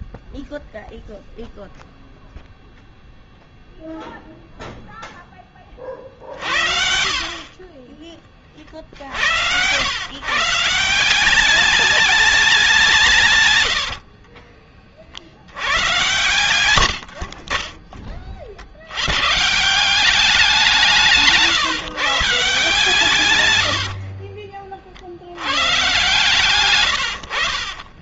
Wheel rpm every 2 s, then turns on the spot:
0, 0, 0, 50, 50, 170, 170, 40, 70, 100, 170, 150, 50, 110.
16-18